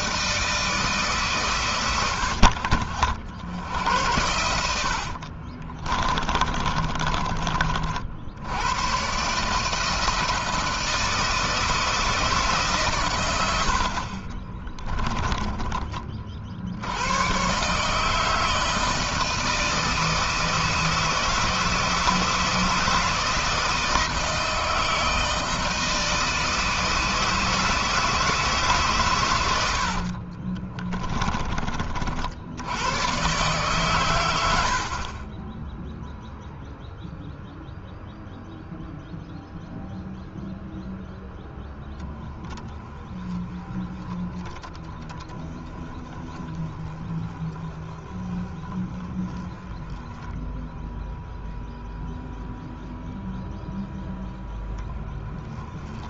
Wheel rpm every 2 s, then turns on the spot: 150, 60, 60, 30, 120, 160, 130, 20, 90, 160, 160, 160, 160, 160, 130, 20, 100, 40, 0, 0, 0, 10, 10, 10, 10, 0, 0, 10.
4-8 30-32 34-36